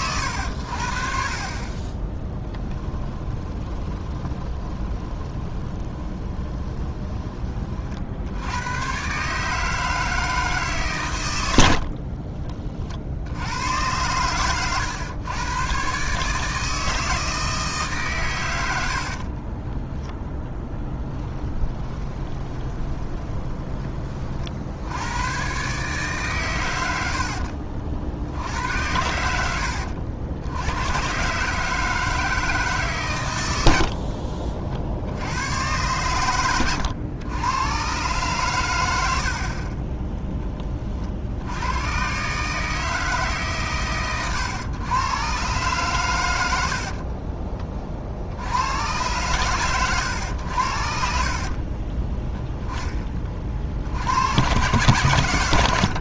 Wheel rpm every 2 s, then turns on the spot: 70, 20, 20, 20, 120, 130, 50, 110, 160, 70, 10, 20, 70, 100, 90, 110, 140, 60, 100, 90, 40, 160, 120, 70, 100, 70, 20, 120.
2-8 18-24 46-48